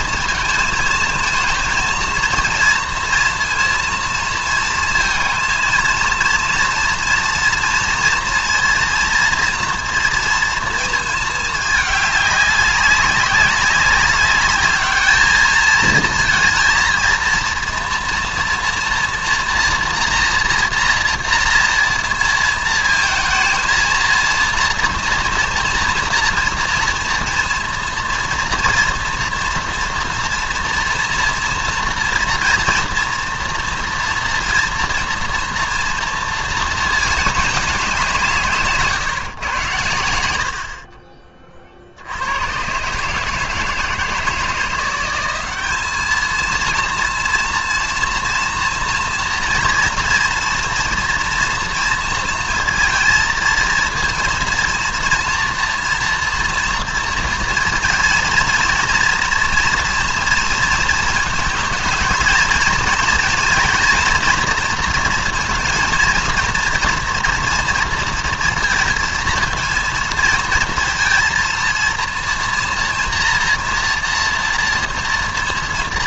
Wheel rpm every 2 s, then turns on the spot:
230, 230, 230, 230, 230, 230, 200, 210, 230, 230, 240, 220, 230, 230, 230, 230, 240, 230, 220, 150, 80, 120, 170, 230, 230, 230, 230, 230, 230, 230, 230, 230, 240, 230, 230, 230, 240, 230.
none